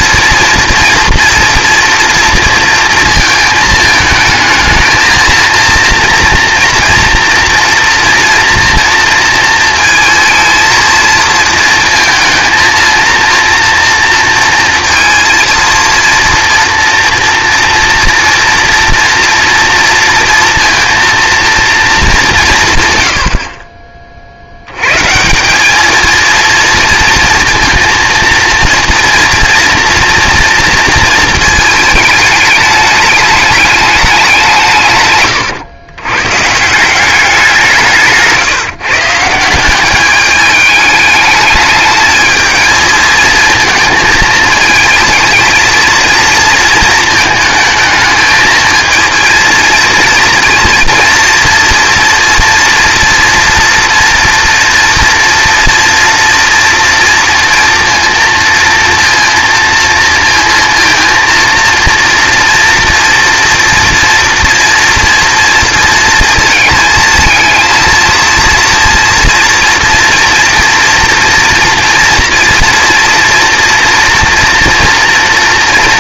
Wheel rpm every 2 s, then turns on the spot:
230, 230, 220, 230, 230, 220, 230, 230, 230, 230, 230, 130, 120, 230, 240, 230, 210, 150, 180, 150, 210, 220, 220, 220, 230, 230, 230, 230, 230, 230, 230, 240, 240, 220, 240, 230, 230, 230.
none